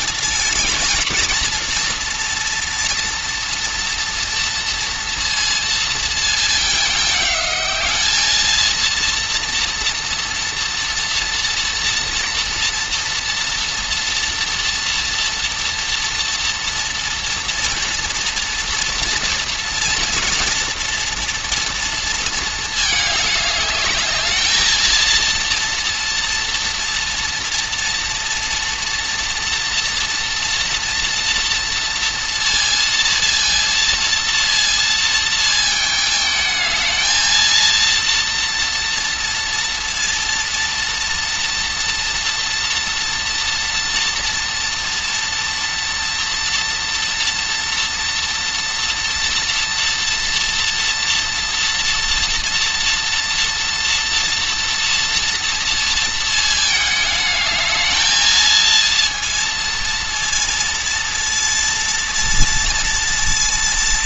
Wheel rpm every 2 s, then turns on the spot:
220, 230, 230, 210, 220, 230, 230, 230, 240, 230, 230, 220, 220, 230, 230, 230, 230, 230, 220, 230, 240, 240, 230, 240, 230, 230, 230, 230, 220, 230, 230, 230.
none